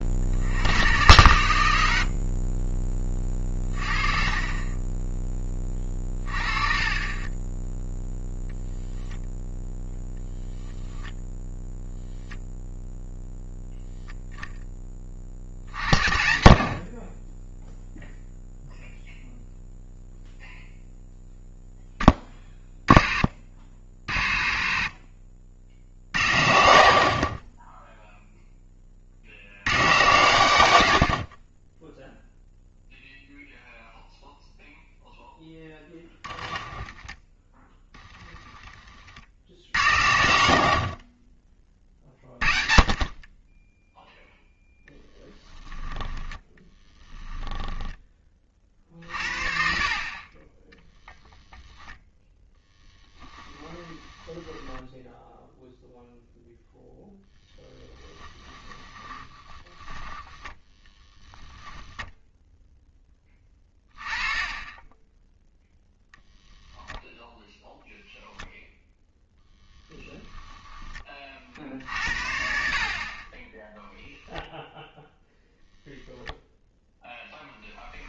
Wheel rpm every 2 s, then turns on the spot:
110, 20, 20, 30, 0, 0, 0, 20, 50, 0, 0, 20, 60, 50, 30, 90, 0, 0, 20, 30, 50, 30, 0, 10, 40, 20, 10, 10, 0, 20, 10, 10, 10, 0, 0, 20, 50, 0, 0.
36-38 46-48 50-54 58-62